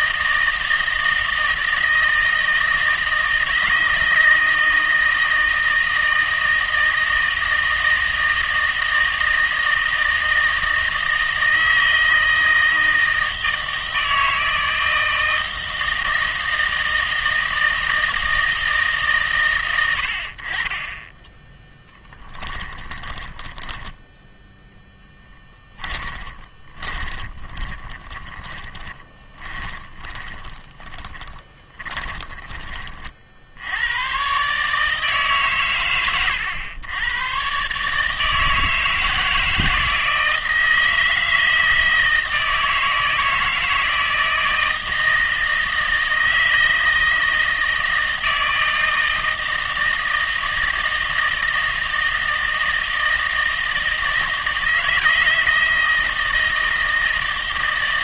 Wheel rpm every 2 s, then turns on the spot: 160, 160, 160, 160, 160, 160, 160, 160, 160, 160, 40, 20, 0, 20, 20, 20, 30, 150, 100, 160, 160, 160, 160, 160, 160, 160, 160, 170, 160.
22-24 26-32